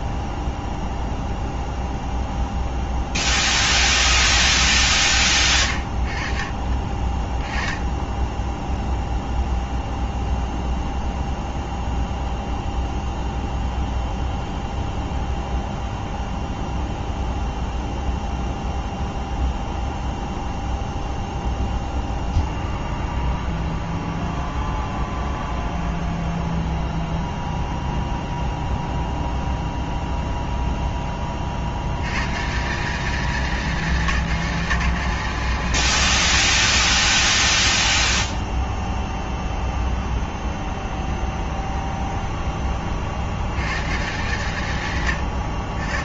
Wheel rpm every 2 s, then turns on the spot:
0, 0, 30, 30, 10, 0, 0, 0, 0, 0, 0, 0, 0, 0, 0, 0, 150, 190, 60, 0, 0, 10, 140.
none